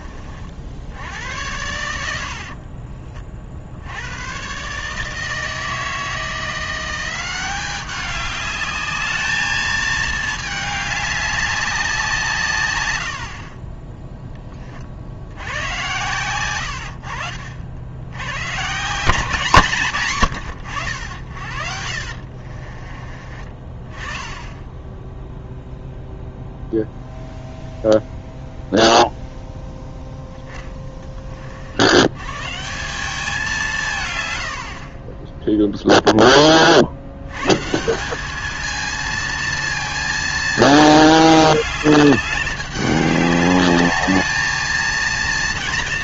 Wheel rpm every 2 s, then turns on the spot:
60, 50, 140, 170, 210, 210, 110, 40, 90, 140, 80, 40, 10, 0, 0, 10, 170, 60, 50, 220, 220, 200, 220.
2-4 22-24